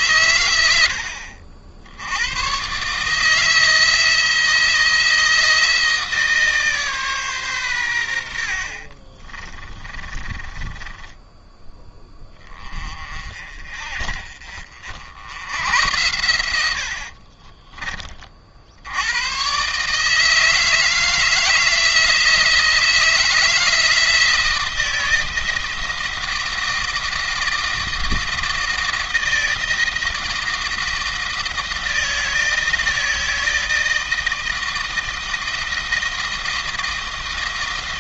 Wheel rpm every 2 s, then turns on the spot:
90, 120, 160, 150, 60, 20, 30, 60, 70, 70, 160, 160, 170, 170, 170, 170, 160, 160, 160.
8-12 16-18